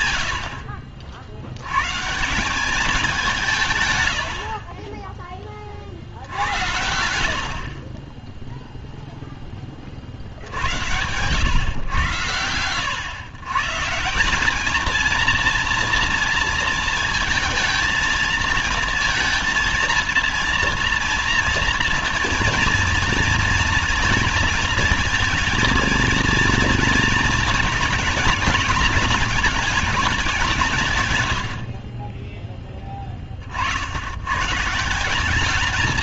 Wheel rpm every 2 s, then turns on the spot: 90, 180, 70, 70, 10, 60, 100, 200, 230, 220, 230, 230, 230, 230, 220, 190, 20, 110.
none